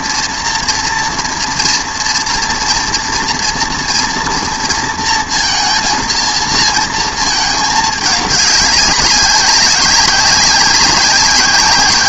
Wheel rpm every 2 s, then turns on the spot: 230, 230, 230, 230, 200, 190.
none